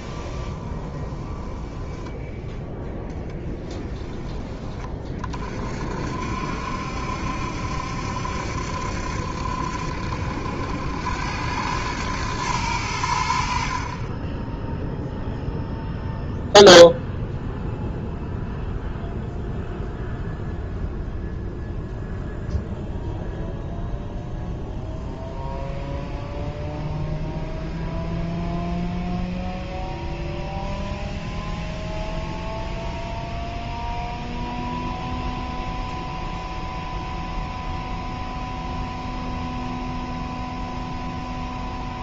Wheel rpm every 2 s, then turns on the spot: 20, 0, 40, 70, 70, 80, 100, 0, 0, 0, 0, 0, 0, 0, 0, 0, 0, 0, 0, 0, 0.
0-2